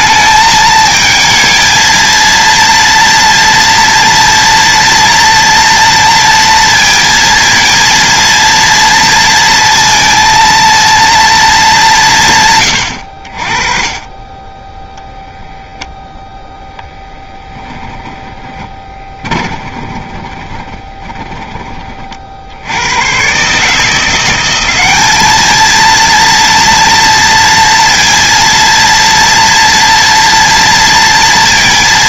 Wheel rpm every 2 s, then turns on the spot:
220, 230, 240, 230, 230, 230, 110, 10, 0, 20, 20, 90, 200, 230, 230, 230.
18-22